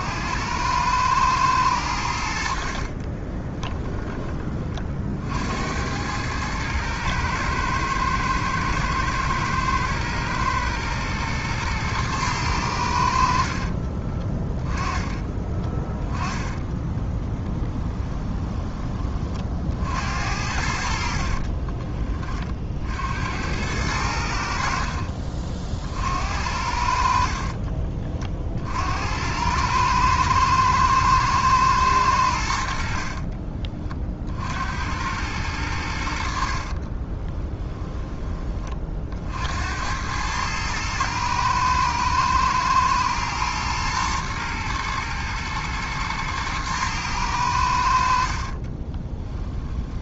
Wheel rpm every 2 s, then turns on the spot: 110, 30, 50, 110, 110, 120, 80, 20, 10, 30, 60, 70, 50, 60, 80, 110, 50, 90, 40, 50, 110, 110, 110, 110, 30.
2-4 16-18 20-22 24-26 36-38 48-50